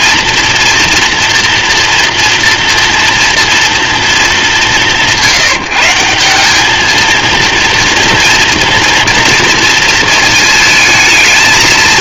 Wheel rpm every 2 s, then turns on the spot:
230, 230, 210, 190, 240, 220.
none